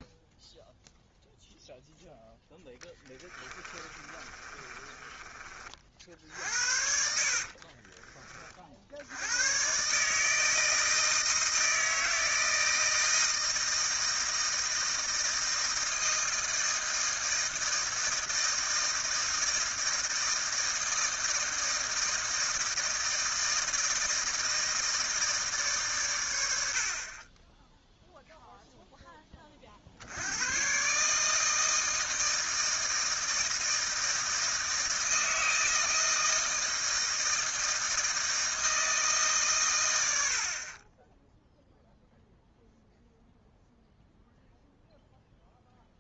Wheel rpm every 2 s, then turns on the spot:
0, 10, 30, 60, 50, 160, 160, 160, 160, 160, 160, 160, 160, 80, 0, 120, 160, 160, 160, 160, 20, 0, 0.
2-6